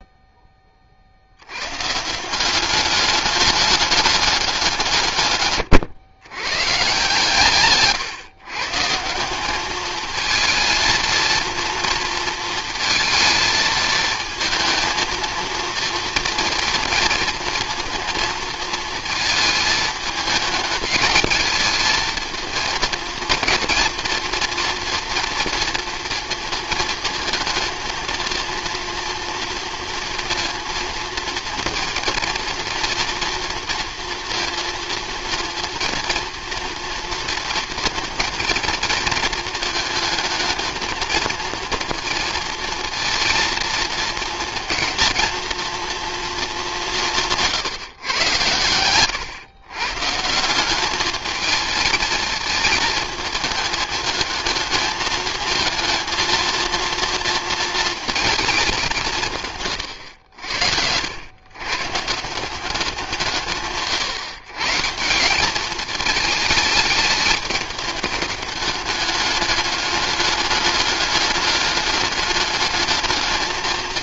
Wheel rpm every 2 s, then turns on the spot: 30, 200, 180, 130, 150, 230, 230, 220, 230, 230, 220, 230, 230, 230, 230, 230, 230, 230, 230, 230, 220, 230, 230, 210, 100, 200, 220, 220, 230, 220, 80, 180, 150, 210, 210, 210, 210.
none